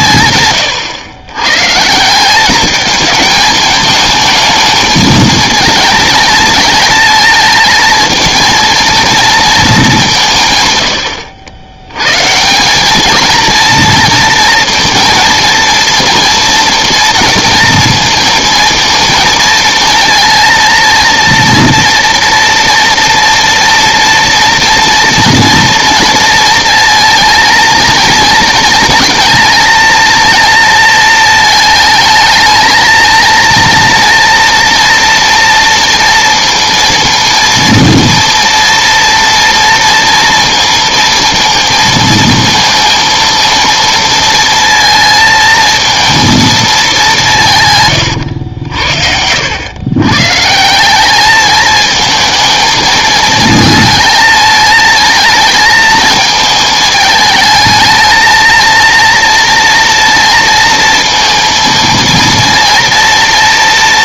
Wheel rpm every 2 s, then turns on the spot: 120, 210, 220, 220, 220, 130, 190, 230, 230, 230, 230, 230, 230, 230, 220, 230, 220, 230, 230, 240, 230, 220, 220, 220, 70, 150, 220, 220, 220, 230, 230, 230.
none